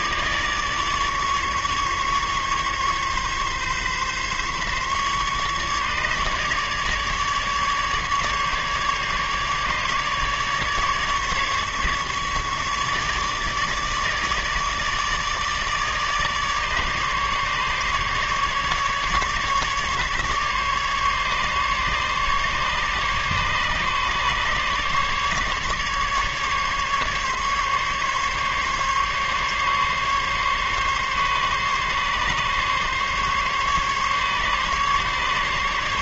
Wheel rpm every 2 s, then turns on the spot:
150, 140, 140, 150, 150, 150, 150, 150, 150, 140, 150, 140, 140, 150, 140, 140, 140, 150.
none